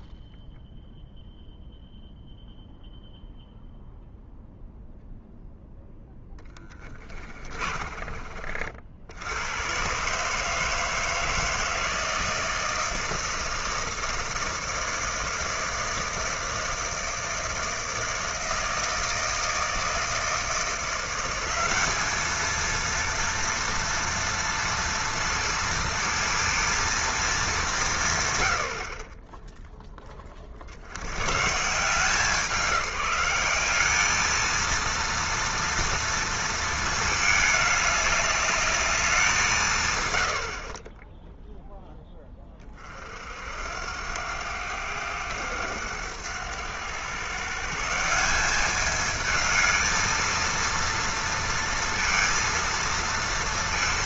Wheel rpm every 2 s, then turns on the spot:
0, 0, 0, 10, 50, 160, 160, 160, 160, 160, 170, 230, 230, 230, 70, 50, 180, 230, 230, 210, 60, 30, 100, 100, 200, 230, 230.
6-8